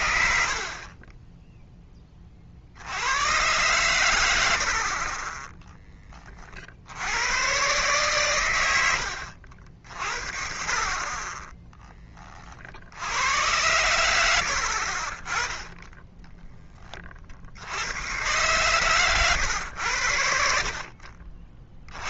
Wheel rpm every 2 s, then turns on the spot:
50, 60, 60, 60, 100, 30, 50, 70, 20, 130, 50.
14-16